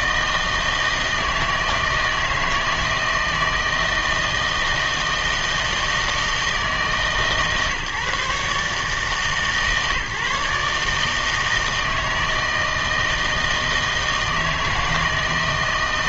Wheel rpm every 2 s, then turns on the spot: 160, 160, 160, 150, 150, 150, 160, 160.
none